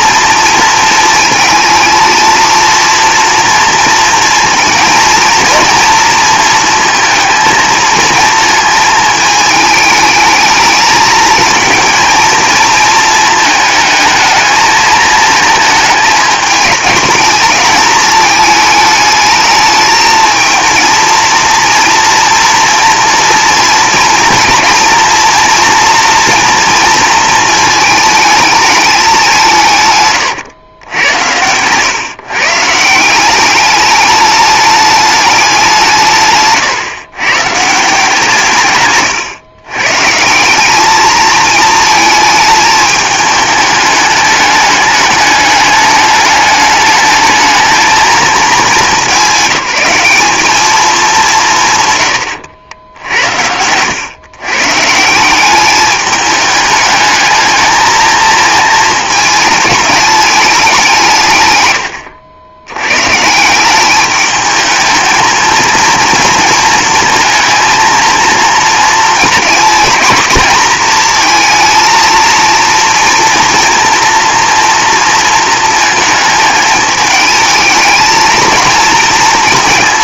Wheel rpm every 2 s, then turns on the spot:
230, 230, 220, 230, 230, 220, 220, 220, 210, 220, 230, 230, 230, 230, 220, 110, 160, 210, 130, 140, 200, 220, 210, 210, 210, 210, 90, 150, 210, 220, 190, 100, 220, 230, 230, 220, 230, 230, 220, 230.
52-54